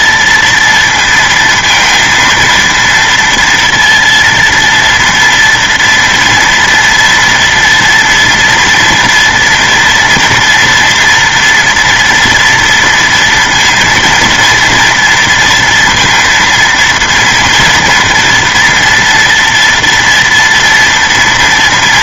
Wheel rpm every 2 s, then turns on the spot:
230, 230, 230, 230, 230, 230, 230, 230, 230, 230, 240.
none